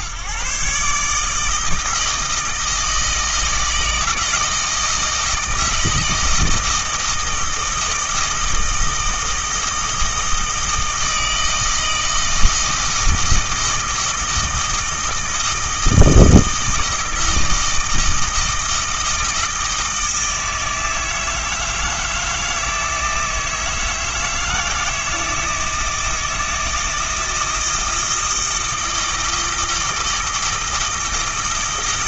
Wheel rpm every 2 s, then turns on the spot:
150, 160, 160, 160, 160, 160, 160, 160, 160, 160, 160, 160, 160, 160, 160, 160.
none